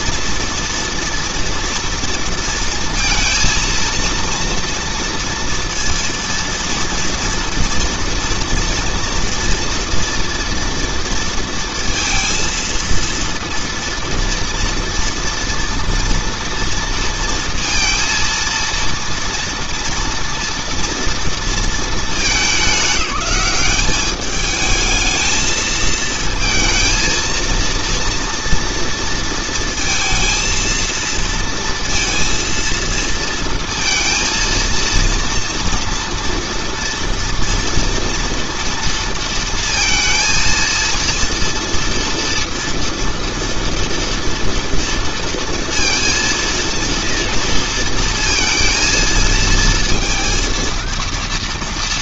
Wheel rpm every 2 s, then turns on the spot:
230, 230, 230, 230, 230, 230, 230, 230, 230, 230, 230, 200, 220, 230, 230, 230, 230, 230, 230, 230, 230, 230, 230, 230, 230, 230.
none